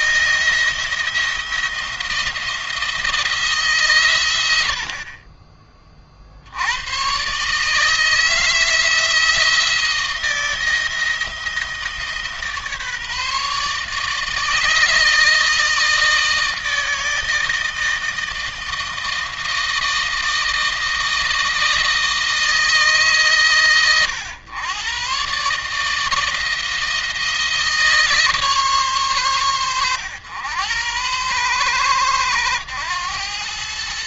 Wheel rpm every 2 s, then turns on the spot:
170, 170, 80, 90, 160, 170, 150, 150, 160, 160, 160, 150, 110, 160, 120, 100, 110.
4-6